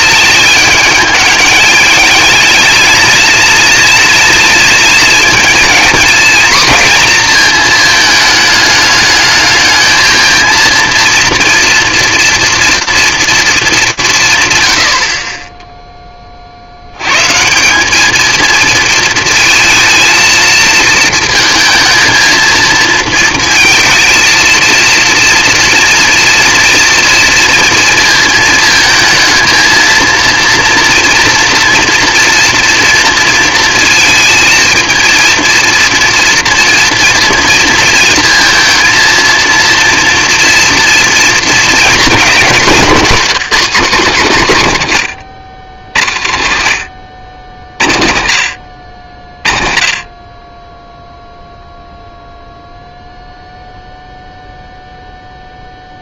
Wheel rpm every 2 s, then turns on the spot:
210, 230, 230, 230, 210, 230, 230, 100, 90, 220, 230, 230, 230, 230, 220, 230, 230, 230, 230, 230, 230, 200, 140, 70, 70, 10, 0, 0.
none